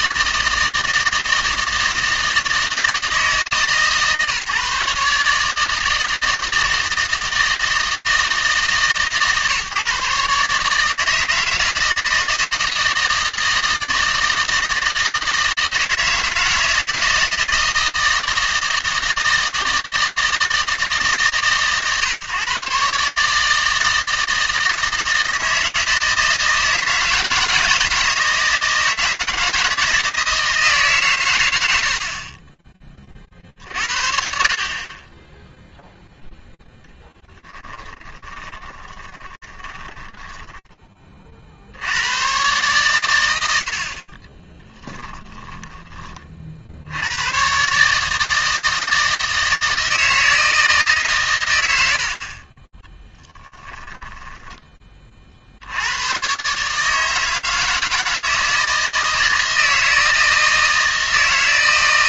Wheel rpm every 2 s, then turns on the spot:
160, 160, 150, 160, 150, 150, 160, 160, 160, 160, 150, 140, 160, 160, 160, 160, 40, 40, 10, 20, 20, 110, 10, 80, 160, 150, 20, 40, 150, 160, 160.
36-40 44-46 52-54